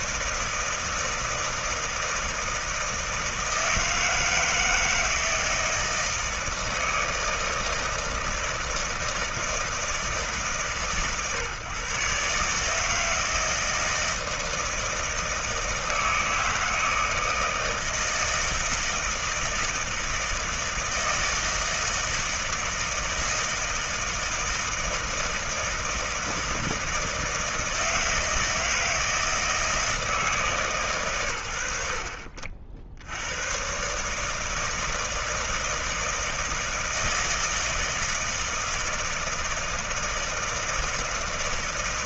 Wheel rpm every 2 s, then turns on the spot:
160, 160, 160, 160, 160, 140, 160, 160, 160, 160, 160, 160, 160, 160, 160, 110, 70, 160, 160, 160, 160.
none